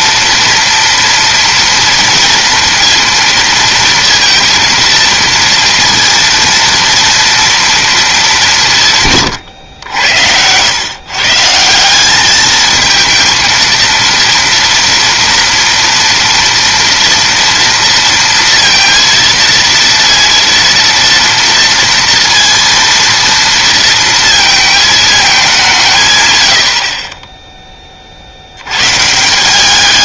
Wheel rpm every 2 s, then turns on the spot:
230, 230, 230, 230, 150, 120, 220, 230, 230, 230, 230, 230, 220, 50, 120.
none